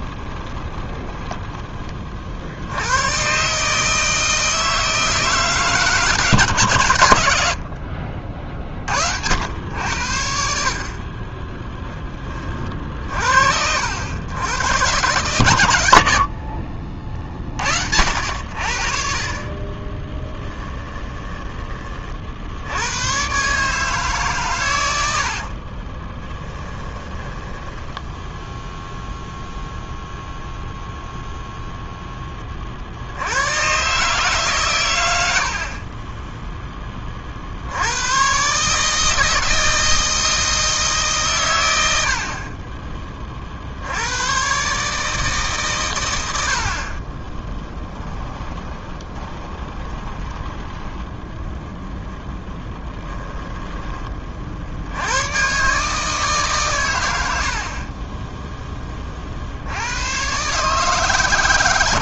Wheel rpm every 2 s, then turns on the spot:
10, 80, 160, 120, 50, 40, 40, 120, 40, 60, 10, 100, 100, 10, 0, 0, 50, 110, 20, 150, 150, 20, 140, 40, 20, 10, 10, 70, 150, 10, 140.
0-2 20-22 26-28 48-54